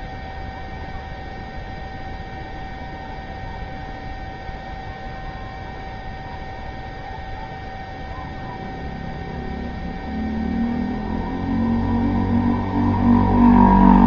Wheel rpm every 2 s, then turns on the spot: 0, 0, 0, 0, 0, 0, 0.
none